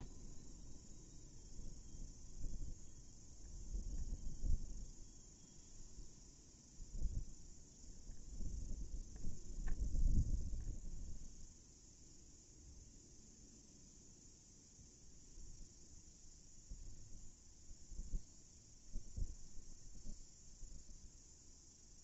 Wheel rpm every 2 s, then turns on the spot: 0, 0, 0, 0, 0, 0, 0, 0, 0, 0, 0.
none